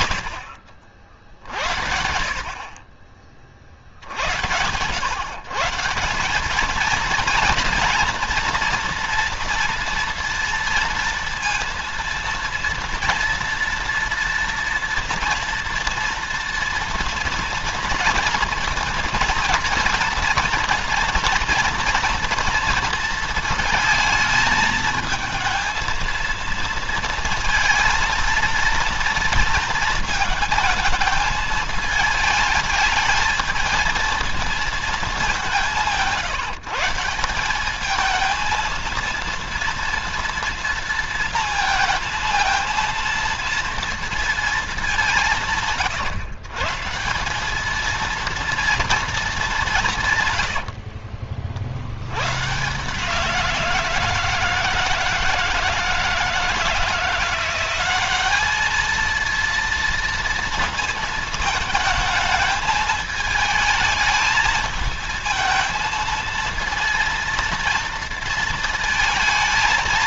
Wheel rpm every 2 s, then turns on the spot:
60, 30, 110, 230, 230, 230, 230, 230, 230, 230, 230, 230, 220, 230, 230, 220, 210, 220, 170, 230, 230, 230, 190, 150, 230, 50, 150, 160, 170, 220, 220, 220, 220, 230, 230.
50-52